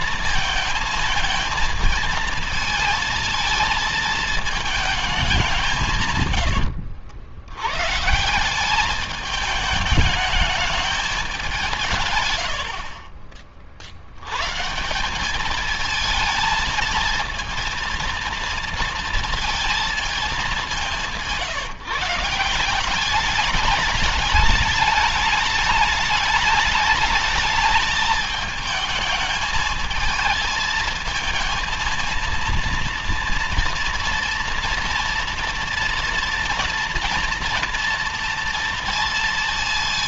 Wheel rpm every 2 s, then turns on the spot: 220, 220, 220, 90, 180, 210, 90, 120, 230, 230, 200, 170, 210, 210, 220, 220, 230, 230, 240, 230.
6-8